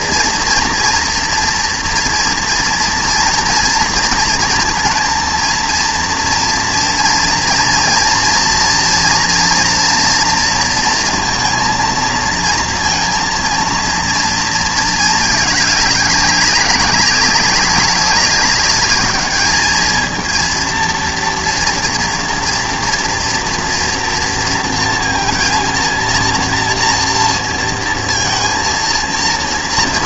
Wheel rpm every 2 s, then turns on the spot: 230, 230, 230, 230, 230, 230, 230, 220, 200, 200, 230, 230, 230, 230, 230.
none